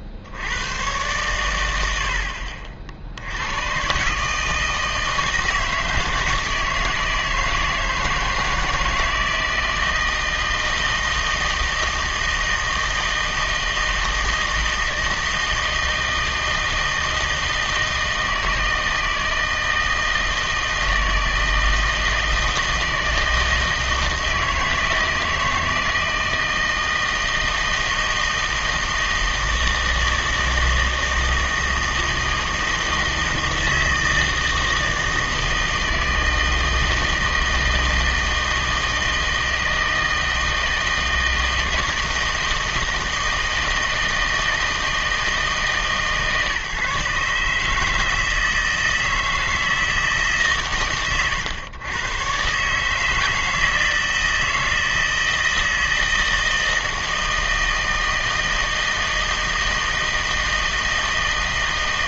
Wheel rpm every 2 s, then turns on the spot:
110, 60, 160, 160, 160, 160, 160, 160, 160, 160, 160, 160, 160, 160, 160, 160, 160, 160, 170, 160, 160, 160, 160, 140, 160, 130, 140, 160, 160, 160, 160.
none